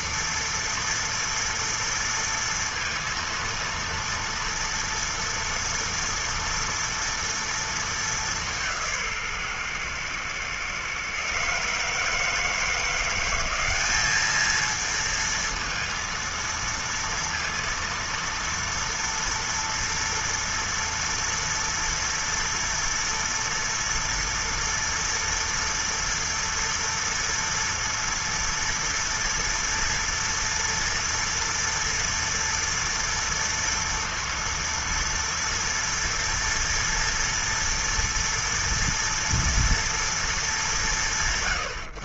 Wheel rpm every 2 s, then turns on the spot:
230, 230, 230, 230, 210, 120, 150, 210, 230, 230, 230, 230, 230, 230, 230, 230, 230, 230, 240, 230, 230.
none